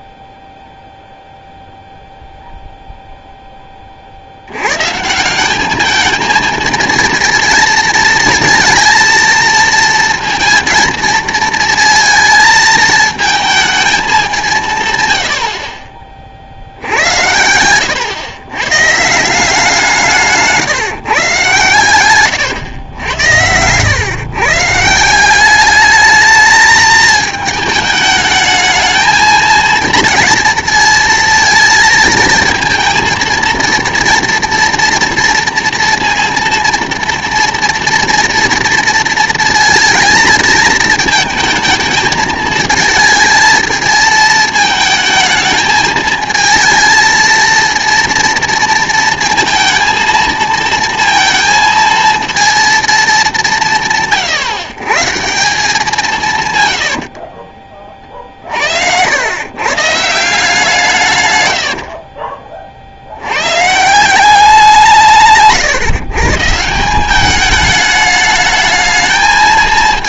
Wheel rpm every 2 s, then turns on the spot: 0, 0, 110, 230, 230, 230, 220, 170, 70, 130, 150, 100, 150, 220, 220, 220, 230, 230, 230, 230, 220, 220, 220, 230, 230, 230, 230, 140, 110, 70, 160, 50, 180, 170, 220.
22-24